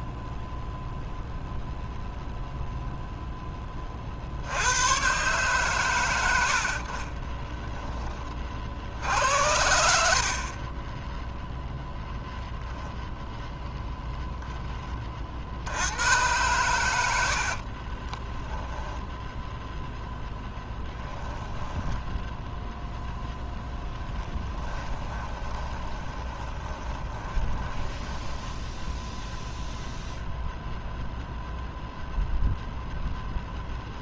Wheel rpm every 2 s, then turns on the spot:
0, 0, 90, 60, 50, 20, 0, 10, 110, 10, 10, 0, 20, 20, 10, 0, 0.
10-12 18-22 24-30